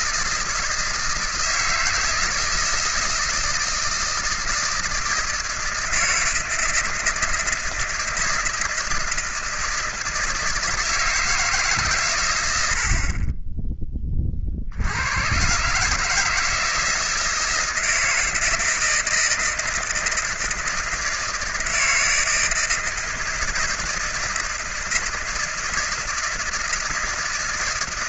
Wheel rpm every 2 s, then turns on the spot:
160, 160, 160, 160, 160, 160, 80, 60, 160, 160, 160, 160, 160, 160.
none